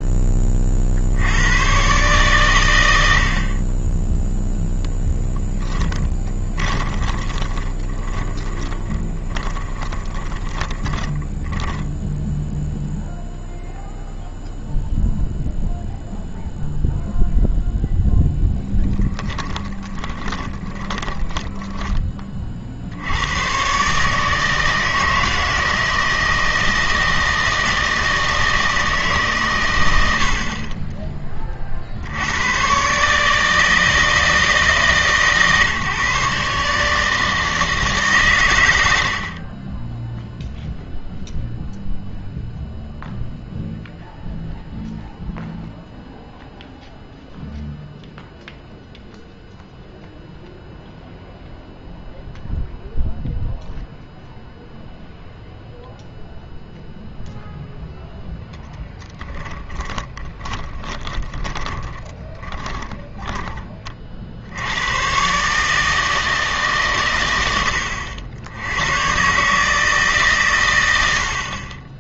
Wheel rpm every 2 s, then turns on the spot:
60, 90, 0, 20, 10, 20, 0, 0, 0, 10, 20, 60, 160, 160, 150, 20, 140, 160, 150, 80, 0, 0, 0, 0, 0, 0, 0, 0, 0, 10, 20, 10, 110, 120, 100, 90.
6-12 18-22 38-40 58-64